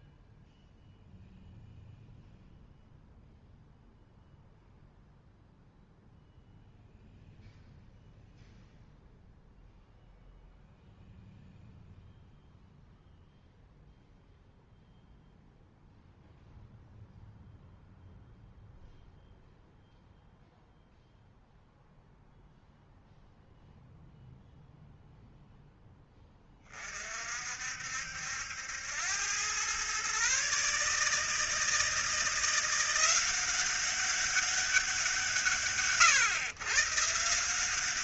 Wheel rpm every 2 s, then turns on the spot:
0, 0, 0, 0, 0, 0, 0, 0, 0, 0, 0, 0, 0, 30, 90, 150, 180, 190, 130.
none